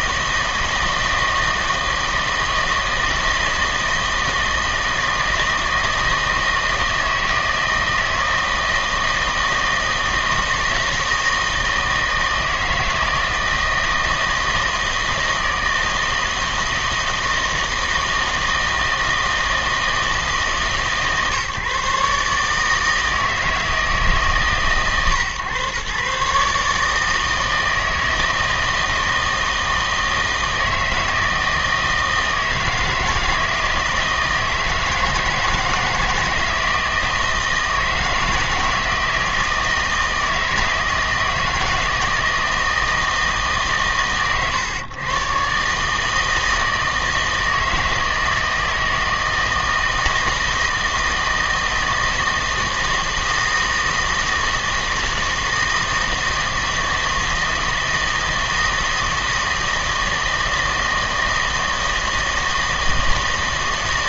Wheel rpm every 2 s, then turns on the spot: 160, 160, 160, 160, 160, 160, 160, 160, 160, 160, 150, 150, 130, 150, 160, 160, 160, 160, 170, 160, 160, 160, 130, 160, 160, 160, 160, 160, 160, 160, 160, 160.
none